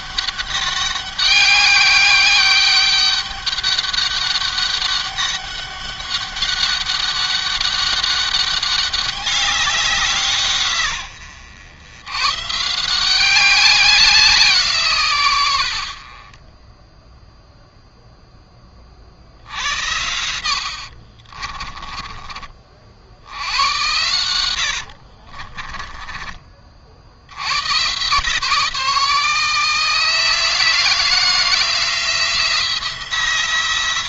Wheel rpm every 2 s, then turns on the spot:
200, 200, 200, 190, 190, 100, 190, 120, 0, 60, 40, 80, 40, 80, 160, 170, 180.
20-22 24-26